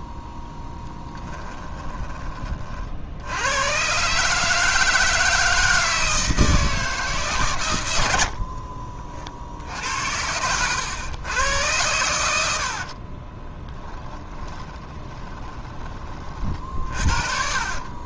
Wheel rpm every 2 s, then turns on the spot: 10, 40, 160, 160, 40, 100, 70, 20, 40.
0-2 8-10 14-16